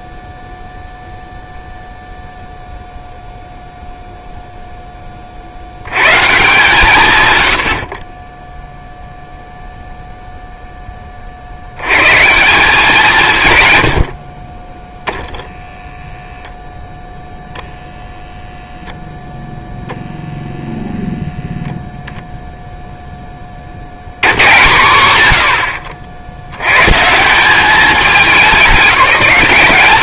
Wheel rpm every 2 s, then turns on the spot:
0, 0, 60, 130, 0, 70, 120, 0, 0, 0, 0, 20, 40, 160, 190.
none